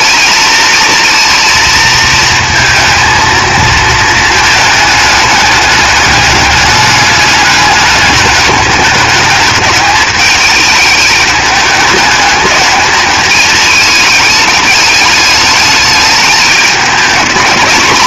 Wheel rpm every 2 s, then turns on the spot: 230, 230, 210, 210, 210, 210, 210, 210, 220.
none